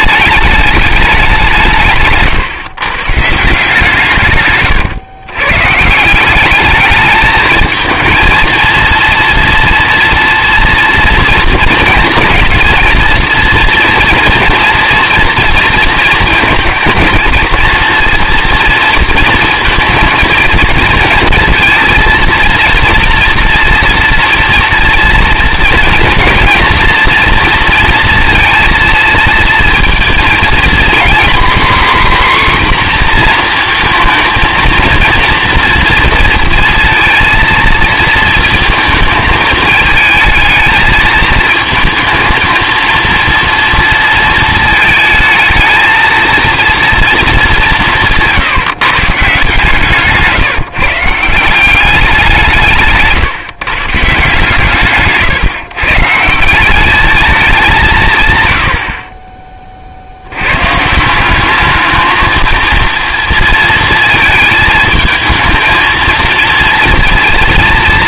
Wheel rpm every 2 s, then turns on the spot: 210, 140, 140, 200, 230, 230, 230, 230, 230, 230, 230, 230, 230, 230, 230, 230, 260, 230, 230, 230, 220, 230, 220, 230, 150, 150, 160, 150, 170, 90, 140, 230, 220, 230.
none